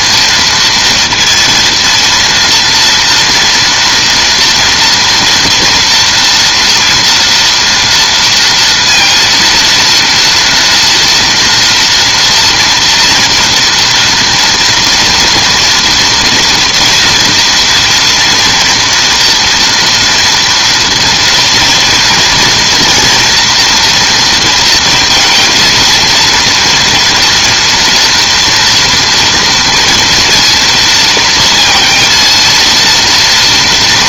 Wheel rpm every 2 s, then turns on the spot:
230, 230, 240, 230, 230, 230, 230, 230, 240, 230, 230, 230, 230, 230, 230, 230, 230.
none